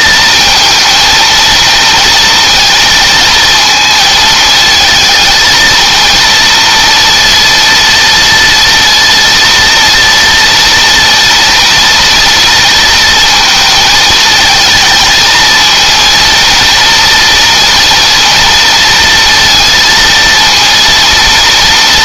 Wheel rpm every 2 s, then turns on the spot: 230, 230, 220, 230, 230, 230, 230, 220, 230, 230, 230.
none